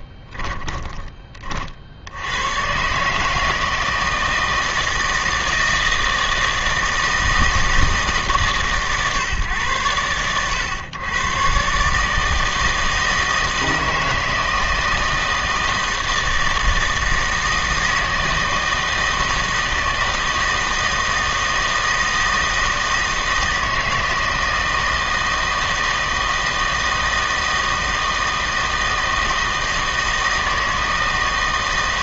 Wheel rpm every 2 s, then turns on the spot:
20, 120, 160, 160, 140, 110, 160, 160, 160, 160, 160, 160, 160, 160, 160, 160.
0-2